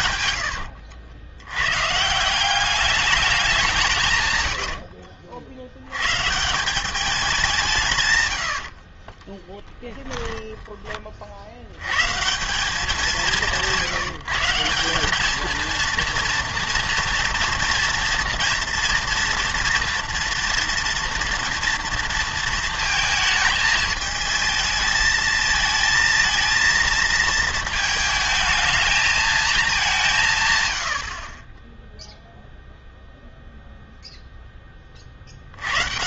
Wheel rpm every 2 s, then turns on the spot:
80, 190, 90, 180, 70, 20, 180, 170, 240, 240, 230, 220, 210, 230, 220, 120, 0, 20.
0-2 4-6 8-12